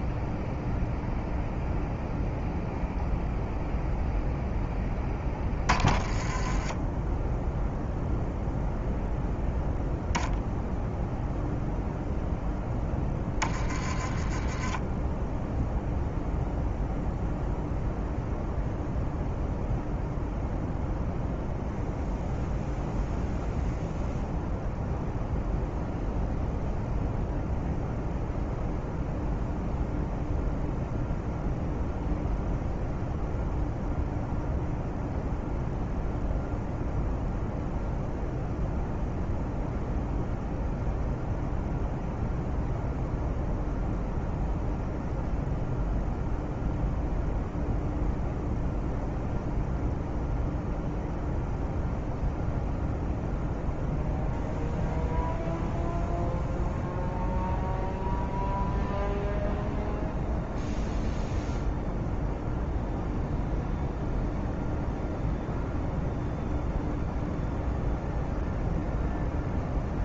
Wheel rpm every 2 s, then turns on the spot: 0, 0, 10, 10, 0, 0, 10, 10, 0, 0, 0, 0, 0, 0, 0, 0, 0, 0, 0, 0, 0, 0, 0, 0, 0, 0, 0, 0, 0, 0, 0, 0, 0, 0, 0.
none